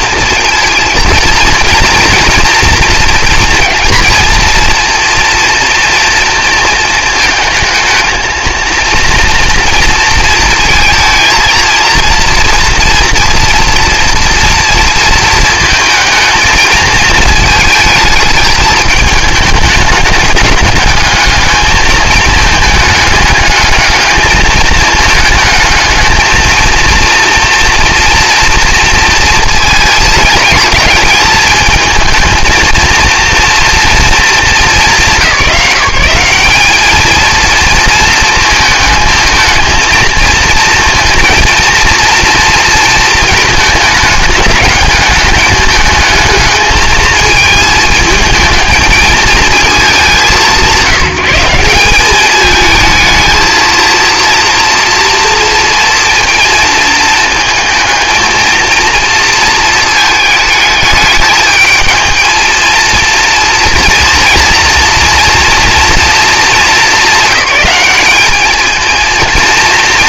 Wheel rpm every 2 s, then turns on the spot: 230, 230, 230, 230, 230, 220, 240, 230, 220, 220, 210, 210, 210, 230, 230, 210, 230, 170, 210, 220, 230, 220, 210, 220, 220, 180, 220, 230, 220, 230, 210, 230, 230, 220, 220.
none